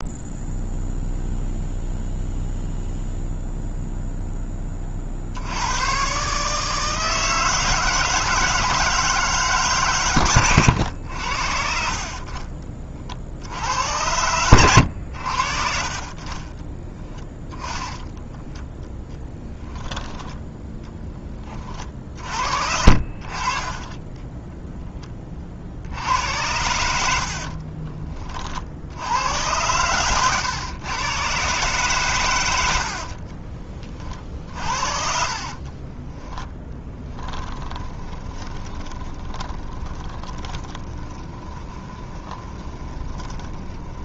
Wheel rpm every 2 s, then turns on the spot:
0, 0, 30, 160, 160, 100, 40, 90, 10, 0, 10, 60, 10, 80, 70, 120, 70, 50, 10, 20, 20, 20.
32-44